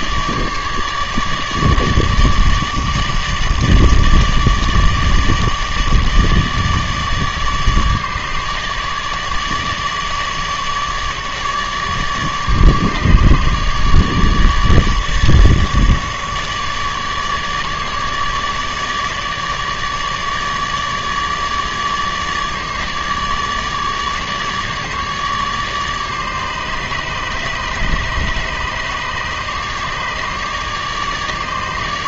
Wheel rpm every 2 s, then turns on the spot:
150, 150, 150, 150, 150, 150, 150, 150, 150, 150, 150, 150, 150, 150, 150, 150.
none